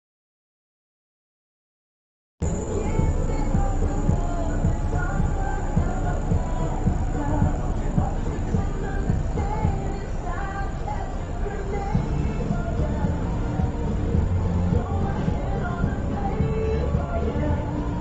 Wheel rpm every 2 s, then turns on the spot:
0, 0, 0, 0, 0, 0, 0, 0, 0.
none